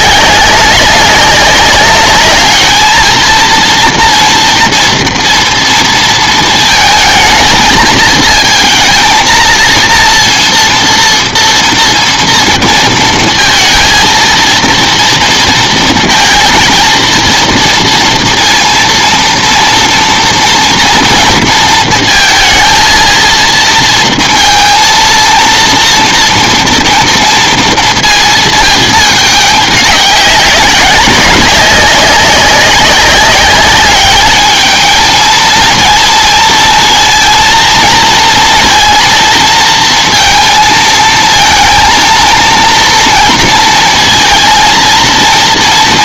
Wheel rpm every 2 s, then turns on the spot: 200, 220, 230, 220, 230, 230, 230, 230, 230, 230, 230, 230, 230, 230, 220, 190, 200, 220, 230, 230, 230, 230, 230.
none